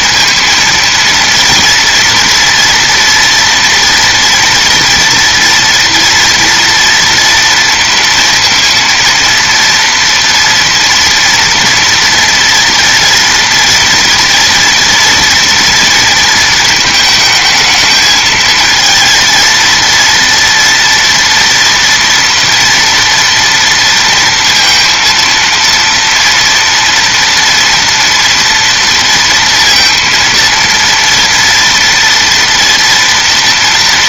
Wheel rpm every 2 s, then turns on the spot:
230, 230, 230, 240, 230, 230, 240, 230, 230, 220, 230, 230, 230, 240, 230, 230, 230.
none